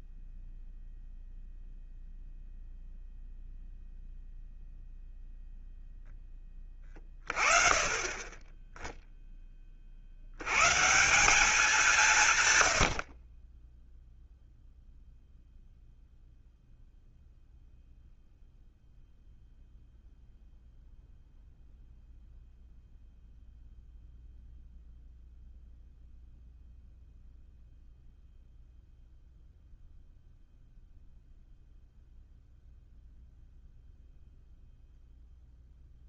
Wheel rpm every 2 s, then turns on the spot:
0, 0, 0, 20, 10, 160, 80, 0, 0, 0, 0, 0, 0, 0, 0, 0, 0, 0.
none